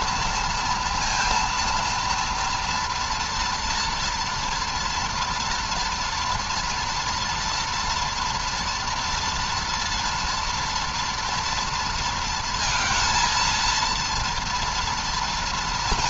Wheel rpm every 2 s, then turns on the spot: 230, 230, 240, 230, 230, 230, 230, 230.
none